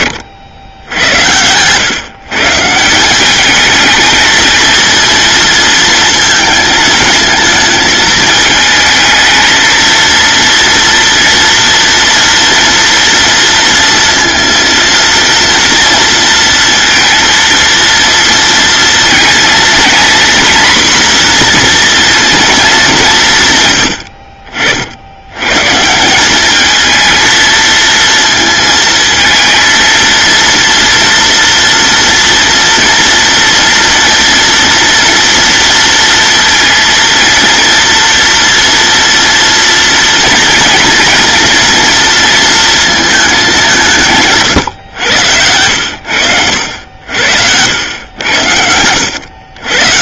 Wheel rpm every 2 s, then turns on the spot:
80, 170, 230, 220, 220, 240, 230, 230, 230, 230, 240, 200, 60, 220, 230, 230, 230, 230, 230, 230, 230, 220, 110, 90, 90.
none